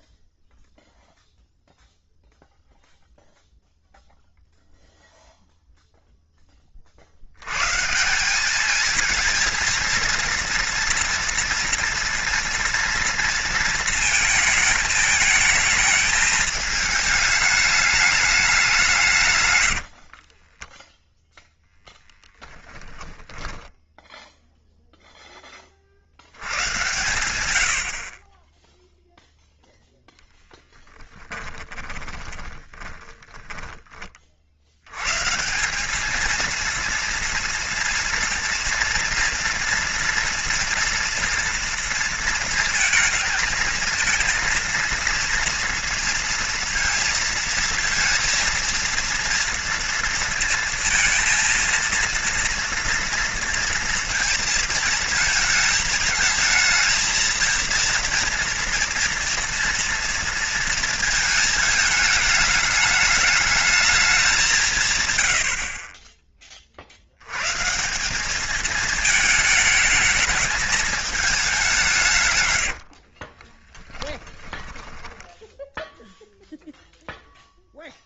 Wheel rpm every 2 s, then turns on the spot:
0, 0, 0, 40, 220, 230, 230, 220, 220, 180, 10, 10, 0, 100, 0, 10, 20, 80, 230, 230, 230, 230, 230, 230, 230, 230, 230, 230, 220, 230, 230, 210, 140, 50, 220, 220, 60, 10, 0.
20-22 30-34 72-76